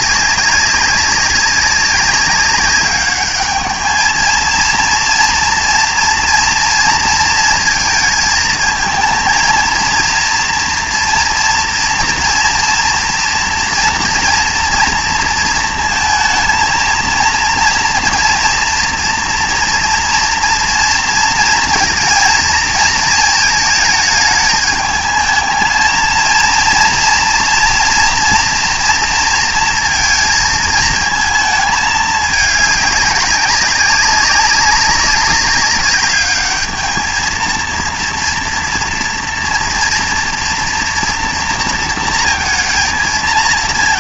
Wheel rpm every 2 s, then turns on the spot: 200, 200, 230, 230, 220, 230, 230, 240, 230, 230, 230, 230, 220, 230, 230, 220, 200, 190, 220, 230, 230, 230.
none